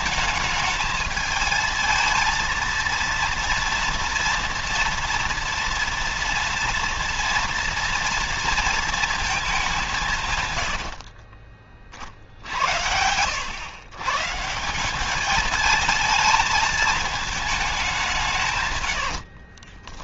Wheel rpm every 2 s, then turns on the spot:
220, 230, 240, 230, 230, 80, 80, 180, 220, 110.
10-12 18-20